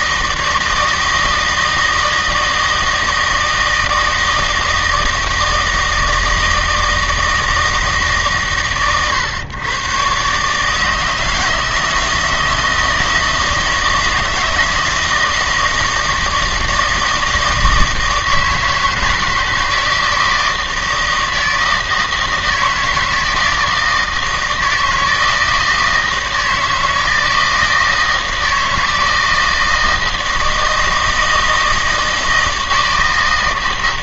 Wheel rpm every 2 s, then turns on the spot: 160, 160, 160, 160, 130, 150, 160, 160, 160, 160, 160, 160, 160, 160, 160, 160, 160.
none